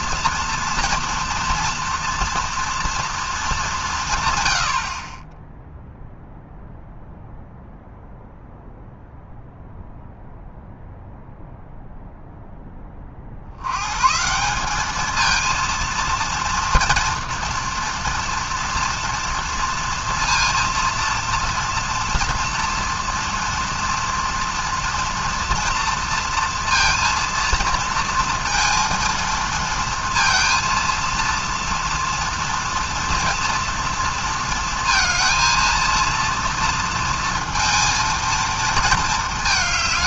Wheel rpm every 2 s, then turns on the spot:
230, 230, 90, 0, 0, 0, 10, 200, 230, 240, 230, 230, 230, 230, 230, 230, 230, 230, 230, 220.
none